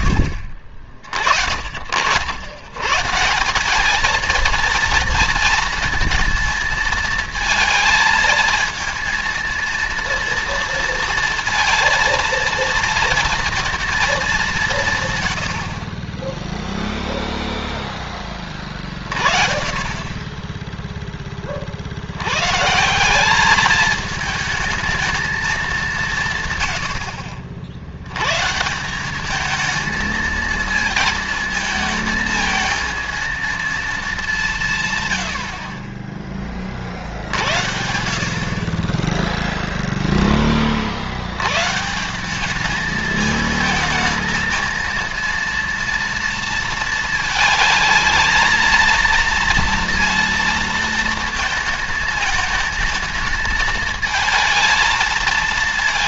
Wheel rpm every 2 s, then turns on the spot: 50, 130, 230, 220, 220, 230, 230, 160, 0, 50, 10, 170, 220, 80, 170, 220, 220, 140, 40, 30, 40, 210, 230, 230, 230, 230, 220, 220.
none